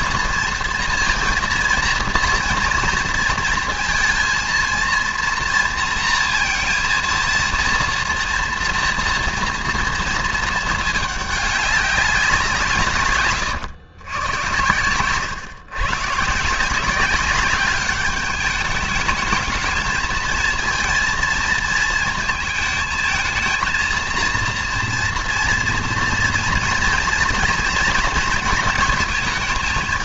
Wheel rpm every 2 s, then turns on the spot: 230, 230, 230, 230, 230, 220, 160, 110, 160, 210, 230, 220, 230, 230, 230.
none